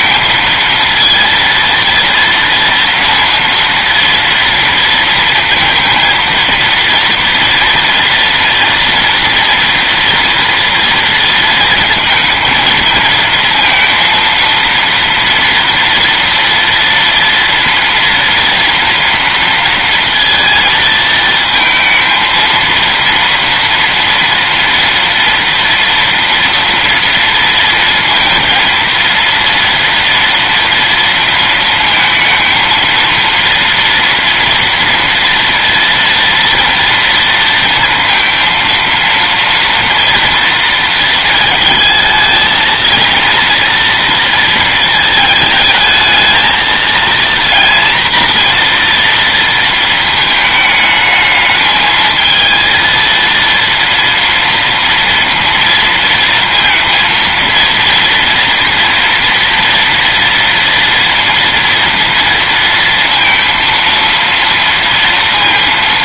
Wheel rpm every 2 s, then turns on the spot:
230, 230, 230, 230, 230, 230, 220, 230, 230, 230, 230, 230, 230, 230, 230, 230, 230, 230, 230, 230, 230, 220, 220, 230, 240, 220, 220, 230, 230, 230, 230, 230, 230.
none